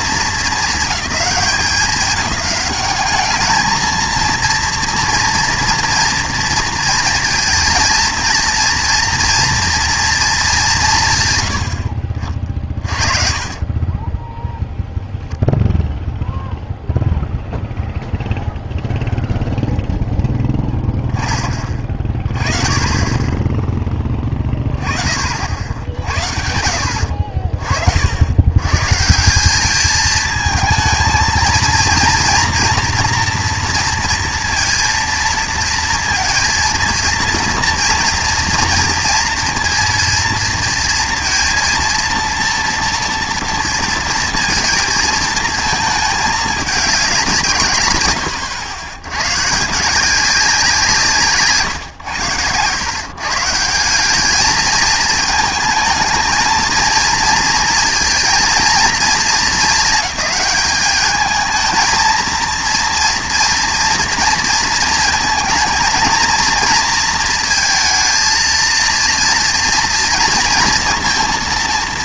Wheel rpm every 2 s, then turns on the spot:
220, 190, 230, 230, 230, 190, 40, 0, 0, 0, 10, 30, 20, 70, 130, 220, 240, 230, 230, 230, 230, 230, 220, 200, 100, 170, 120, 210, 230, 230, 210, 230, 230, 230, 230, 230.
12-14 26-28